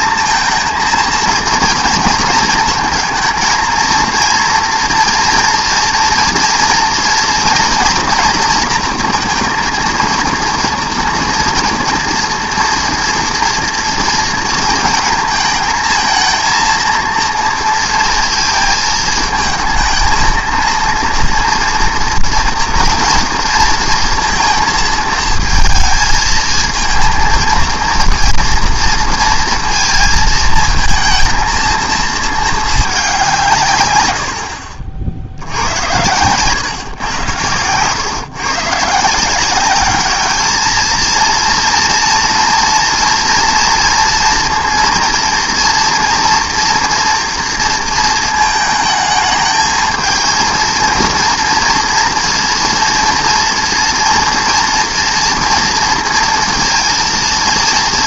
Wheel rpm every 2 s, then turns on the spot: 230, 230, 230, 230, 230, 230, 230, 230, 230, 230, 230, 230, 230, 230, 230, 220, 210, 60, 120, 140, 220, 230, 230, 240, 220, 230, 230, 230, 230.
none